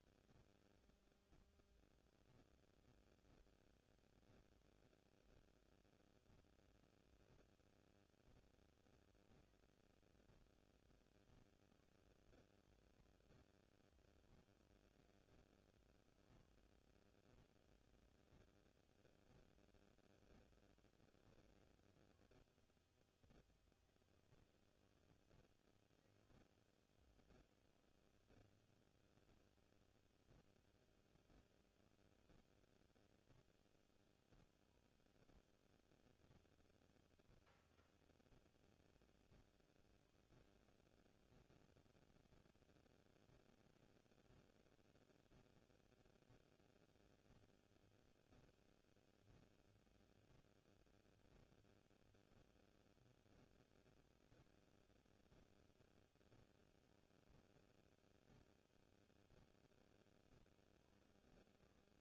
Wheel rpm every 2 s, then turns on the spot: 0, 0, 0, 0, 0, 0, 0, 0, 0, 0, 0, 0, 0, 0, 0, 0, 0, 0, 0, 0, 0, 0, 0, 0, 0, 0, 0, 0, 0, 0, 0.
none